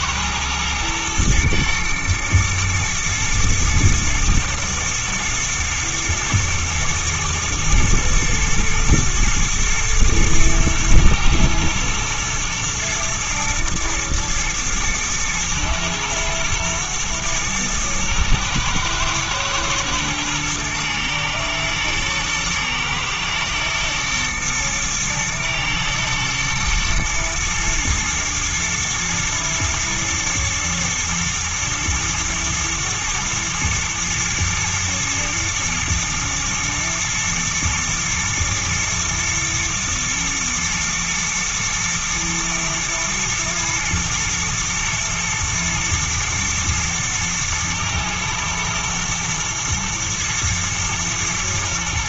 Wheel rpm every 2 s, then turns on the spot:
120, 120, 110, 120, 110, 110, 120, 110, 120, 110, 110, 120, 120, 110, 110, 120, 110, 110, 120, 110, 120, 120, 110, 110, 120, 120.
none